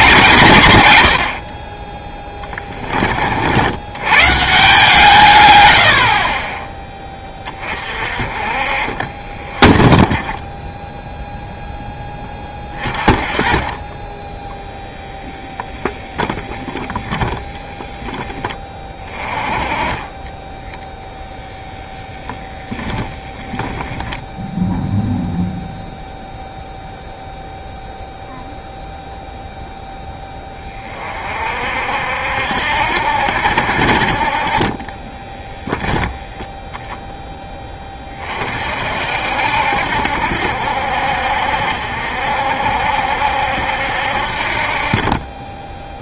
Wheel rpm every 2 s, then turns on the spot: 100, 20, 150, 20, 40, 10, 30, 10, 20, 20, 20, 10, 0, 0, 0, 20, 70, 30, 10, 40, 60, 60, 50.
14-18 22-24 34-36